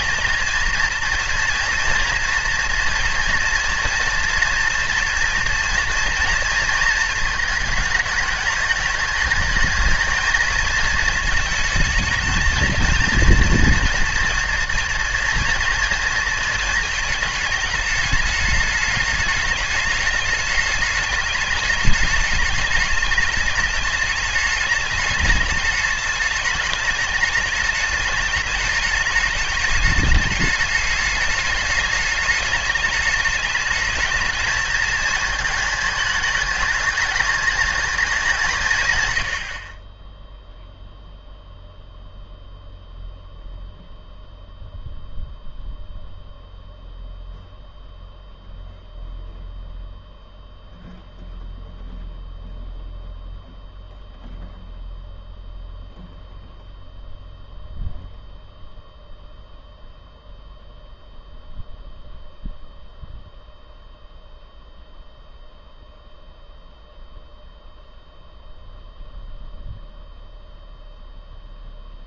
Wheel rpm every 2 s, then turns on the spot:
220, 230, 230, 230, 210, 220, 220, 230, 220, 210, 210, 210, 210, 210, 210, 210, 210, 220, 210, 150, 0, 0, 0, 0, 0, 0, 0, 0, 0, 0, 0, 0, 0, 0, 0, 0.
none